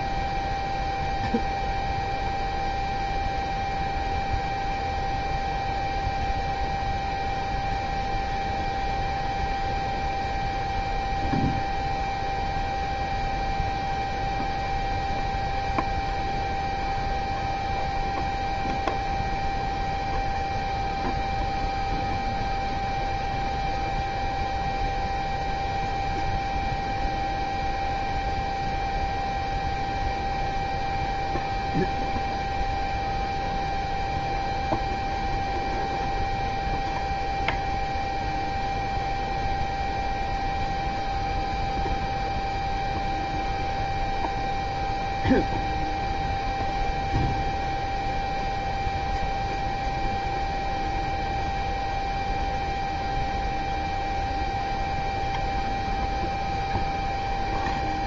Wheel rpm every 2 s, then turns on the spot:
0, 0, 0, 0, 0, 0, 0, 0, 0, 0, 0, 0, 0, 0, 0, 0, 0, 0, 0, 0, 0, 0, 0, 0, 0, 0, 0, 0, 0.
none